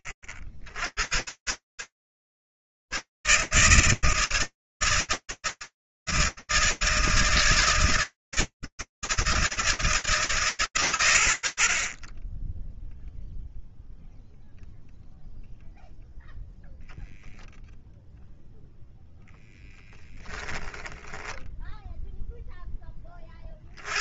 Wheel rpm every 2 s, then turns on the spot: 80, 150, 150, 160, 160, 160, 40, 0, 0, 0, 0, 0.
none